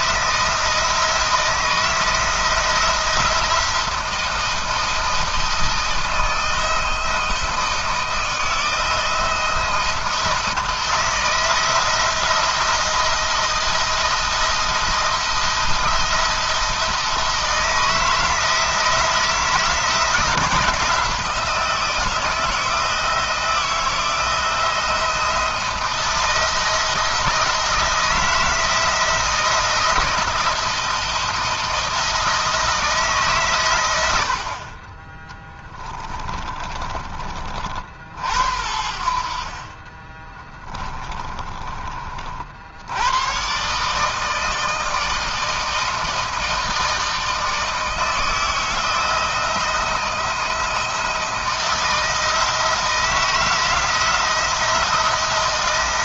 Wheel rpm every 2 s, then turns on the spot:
160, 170, 160, 160, 160, 160, 170, 170, 160, 170, 170, 160, 170, 170, 160, 170, 160, 40, 30, 70, 20, 70, 160, 160, 160, 160, 160, 170.
36-38 40-42